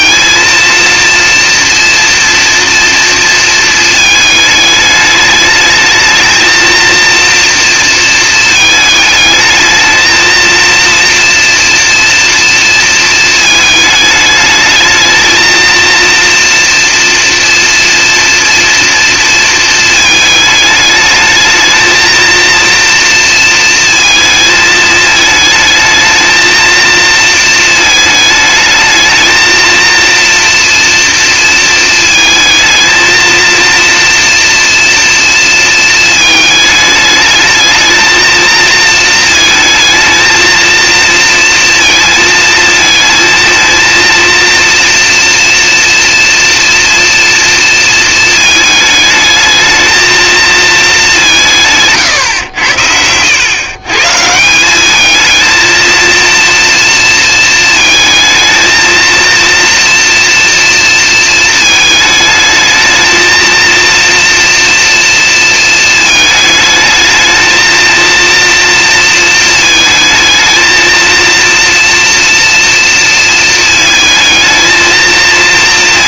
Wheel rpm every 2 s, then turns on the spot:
230, 230, 210, 230, 220, 230, 230, 220, 230, 230, 220, 230, 220, 220, 220, 230, 220, 230, 210, 220, 230, 220, 230, 240, 220, 220, 90, 200, 230, 220, 230, 220, 230, 220, 230, 230, 230, 220.
none